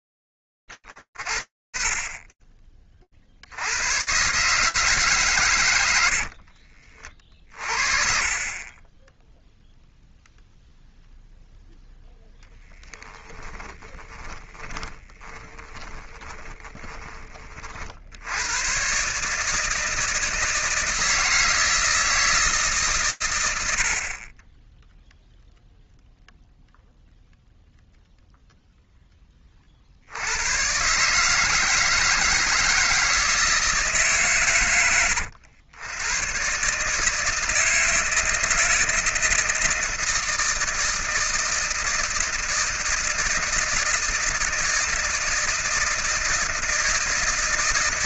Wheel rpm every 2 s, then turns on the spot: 10, 10, 140, 40, 30, 0, 10, 20, 20, 130, 160, 140, 10, 0, 20, 150, 160, 90, 160, 160, 160, 170, 160, 170.
6-8 14-16